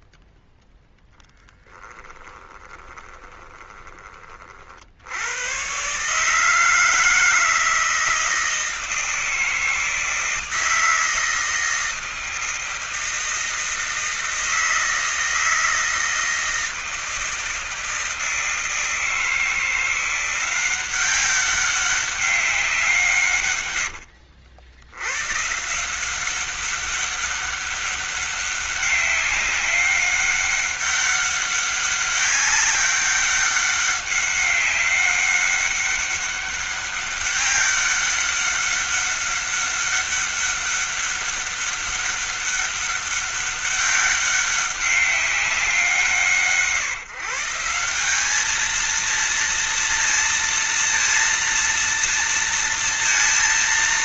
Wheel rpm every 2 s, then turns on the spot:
0, 20, 40, 150, 160, 160, 160, 160, 160, 160, 180, 190, 90, 190, 200, 200, 200, 190, 200, 200, 200, 200, 200, 150, 210, 230, 230.
2-4